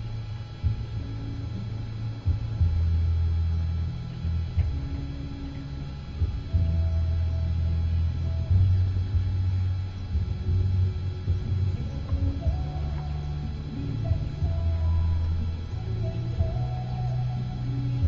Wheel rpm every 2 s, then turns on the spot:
0, 0, 0, 0, 0, 0, 0, 0, 0.
none